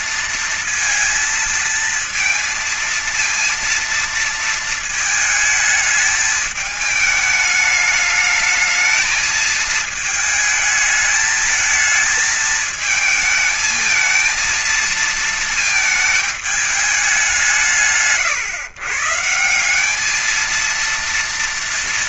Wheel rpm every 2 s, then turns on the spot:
230, 230, 230, 210, 210, 220, 220, 230, 220, 130, 220.
none